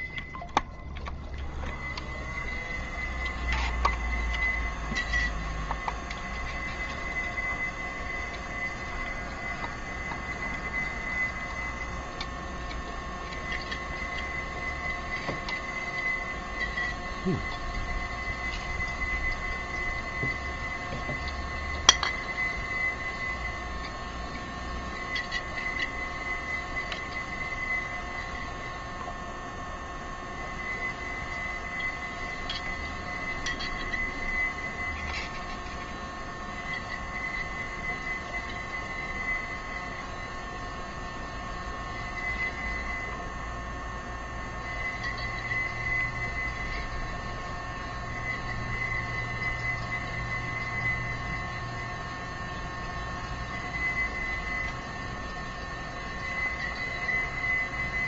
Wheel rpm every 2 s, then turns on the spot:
0, 0, 0, 0, 0, 0, 0, 0, 0, 0, 0, 0, 0, 0, 0, 0, 0, 0, 0, 0, 0, 0, 0, 0, 0, 0, 0, 0, 0.
none